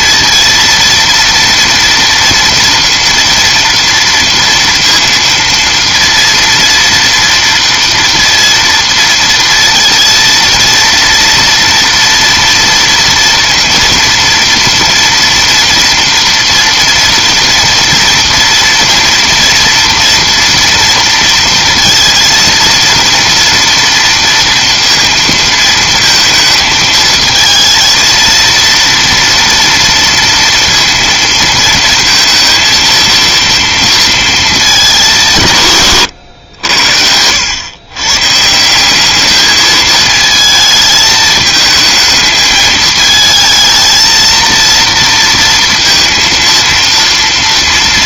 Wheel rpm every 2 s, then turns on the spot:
230, 230, 230, 230, 230, 230, 230, 230, 230, 230, 230, 230, 230, 220, 230, 230, 230, 200, 80, 170, 220, 220, 230, 230.
none